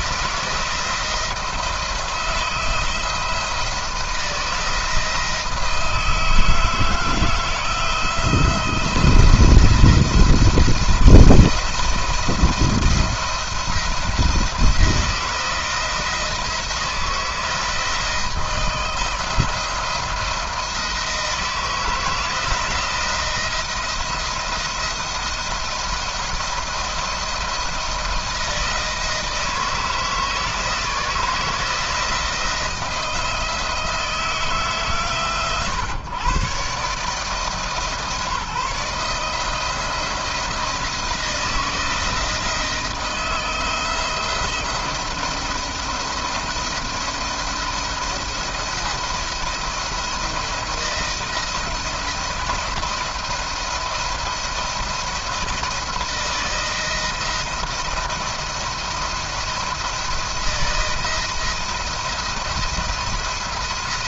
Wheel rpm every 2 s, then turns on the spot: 160, 170, 170, 160, 170, 170, 170, 160, 170, 170, 170, 170, 160, 160, 170, 160, 170, 150, 150, 160, 160, 170, 170, 170, 170, 170, 170, 160, 160, 170, 170, 170.
none